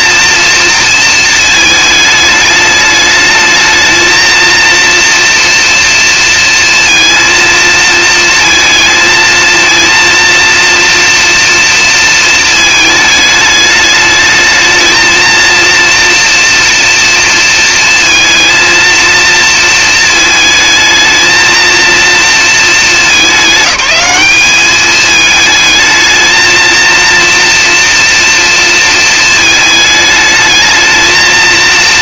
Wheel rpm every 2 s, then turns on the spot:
230, 210, 230, 230, 220, 230, 220, 220, 230, 230, 220, 220, 210, 230, 230, 220.
none